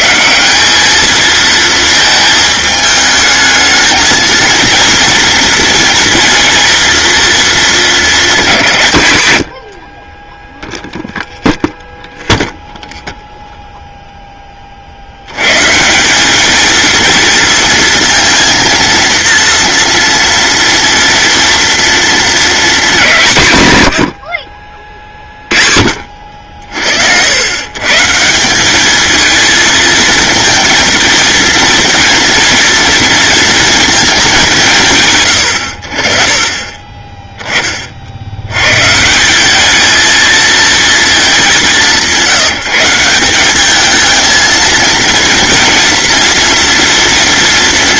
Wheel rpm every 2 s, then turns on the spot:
200, 220, 230, 230, 150, 0, 0, 40, 230, 230, 230, 230, 60, 60, 200, 230, 230, 190, 20, 110, 230, 180, 220, 240.
none